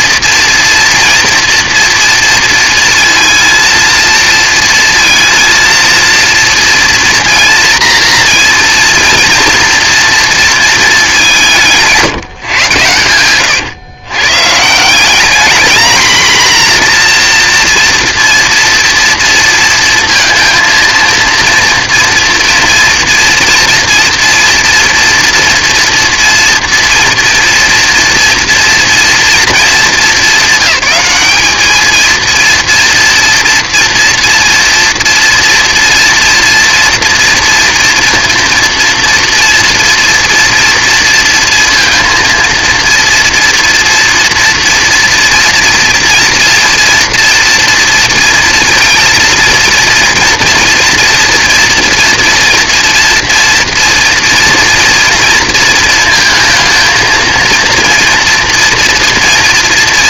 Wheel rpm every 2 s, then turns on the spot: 230, 230, 230, 230, 230, 220, 120, 160, 240, 230, 230, 230, 230, 230, 230, 200, 230, 230, 230, 230, 230, 230, 230, 230, 230, 240, 230, 230, 230, 230.
none